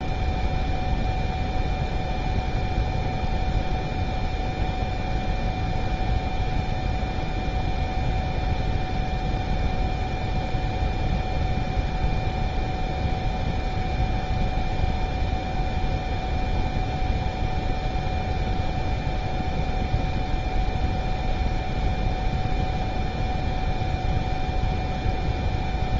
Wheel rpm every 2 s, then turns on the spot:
0, 0, 0, 0, 0, 0, 0, 0, 0, 0, 0, 0, 0.
none